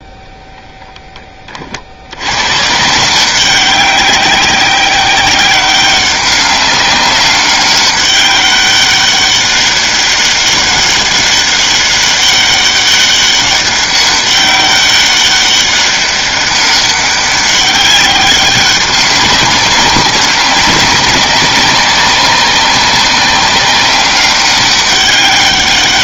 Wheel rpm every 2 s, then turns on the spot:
10, 140, 190, 200, 200, 200, 200, 200, 200, 190, 190, 190, 200.
none